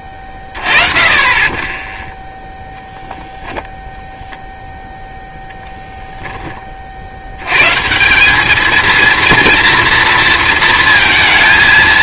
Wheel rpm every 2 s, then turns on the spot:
30, 0, 0, 140, 230, 220.
none